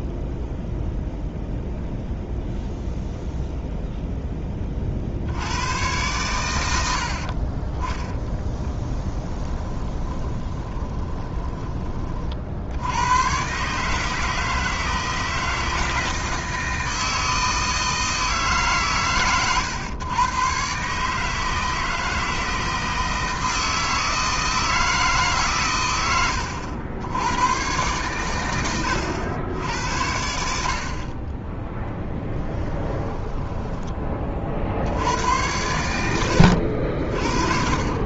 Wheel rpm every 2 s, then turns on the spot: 0, 0, 40, 80, 10, 20, 70, 160, 160, 150, 130, 160, 160, 80, 90, 50, 10, 70, 60.
8-12 32-34